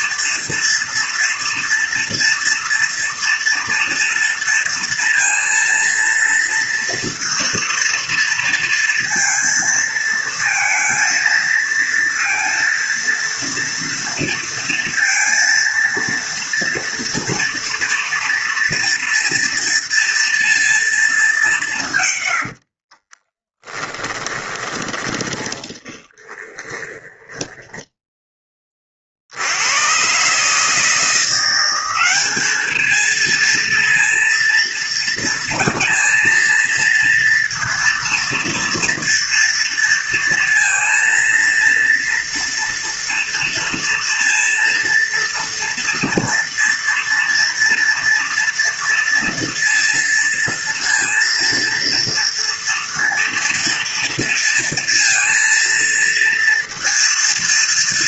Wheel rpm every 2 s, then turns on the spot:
230, 230, 230, 230, 230, 230, 230, 230, 230, 230, 230, 70, 20, 20, 30, 150, 210, 230, 230, 230, 230, 230, 230, 230, 230, 230, 230, 230, 230.
22-28